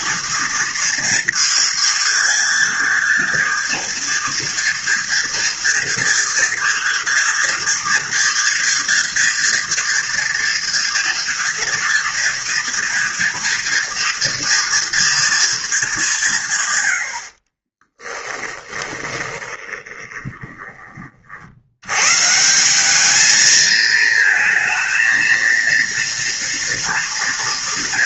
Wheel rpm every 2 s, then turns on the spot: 230, 230, 230, 230, 230, 230, 240, 240, 130, 20, 20, 180, 220, 230.
18-22